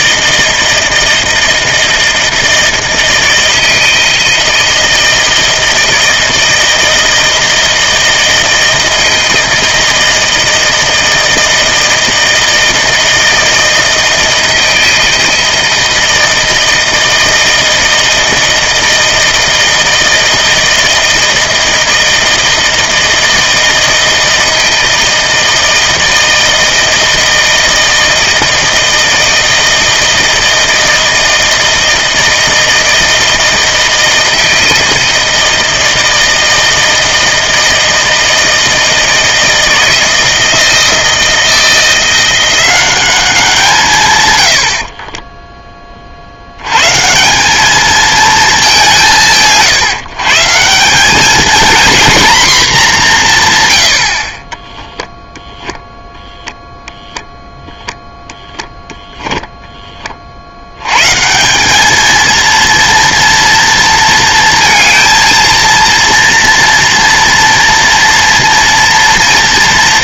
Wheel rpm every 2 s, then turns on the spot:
160, 160, 160, 160, 160, 160, 160, 160, 160, 160, 160, 160, 160, 160, 160, 160, 160, 160, 160, 160, 160, 180, 70, 90, 210, 160, 230, 20, 0, 10, 80, 230, 230, 230, 230.
54-56 58-60